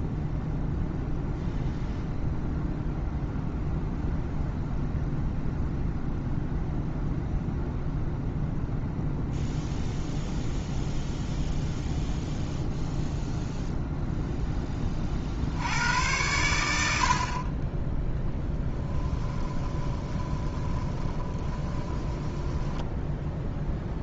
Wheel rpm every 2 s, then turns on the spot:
0, 0, 0, 0, 0, 0, 0, 20, 80, 10, 20, 10.
18-24